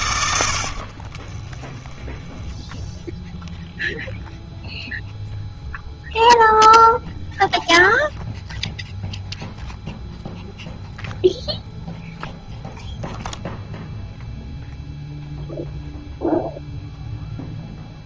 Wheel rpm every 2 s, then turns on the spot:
50, 10, 0, 0, 0, 0, 0, 0, 0.
0-2